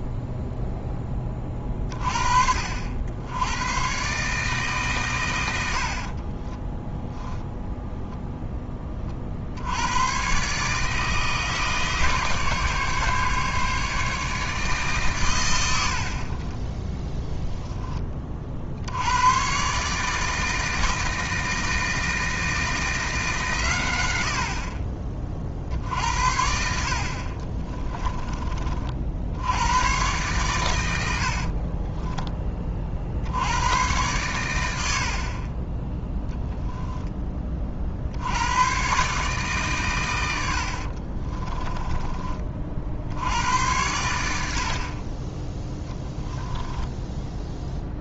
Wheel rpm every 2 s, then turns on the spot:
10, 70, 140, 10, 20, 150, 150, 140, 10, 70, 160, 160, 40, 50, 50, 100, 50, 80, 0, 120, 60, 60, 30, 10.
6-8 16-18 40-42 46-48